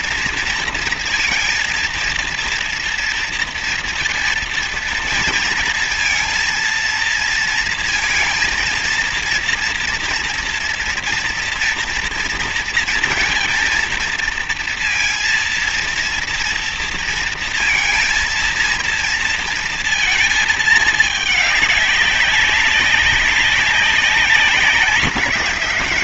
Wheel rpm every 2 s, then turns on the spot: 230, 230, 230, 230, 230, 240, 230, 230, 230, 230, 220, 190, 190.
none